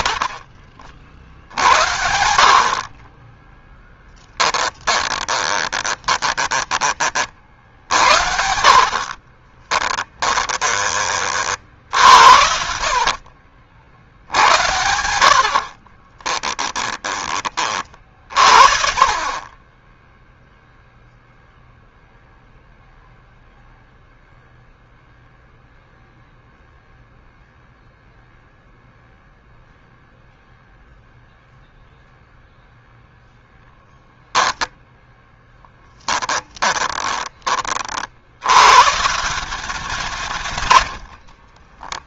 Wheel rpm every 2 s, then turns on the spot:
40, 50, 20, 30, 50, 20, 80, 80, 10, 50, 0, 0, 0, 0, 0, 0, 0, 10, 20, 130, 100.
2-6 8-10 12-14 34-36 40-42